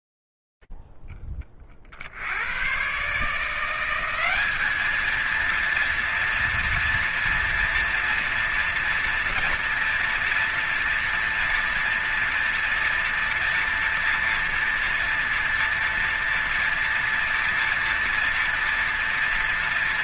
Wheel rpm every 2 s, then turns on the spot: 0, 50, 170, 230, 230, 230, 230, 230, 230, 230.
none